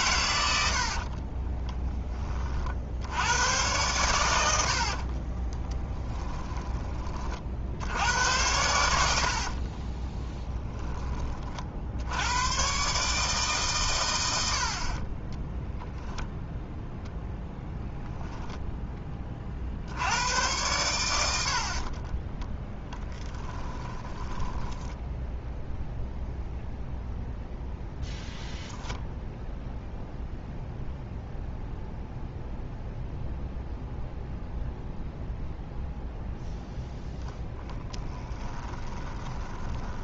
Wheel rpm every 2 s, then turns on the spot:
80, 60, 80, 20, 90, 20, 130, 50, 0, 10, 100, 10, 10, 0, 0, 0, 0, 0, 0, 20.
0-2 4-6 22-24 38-40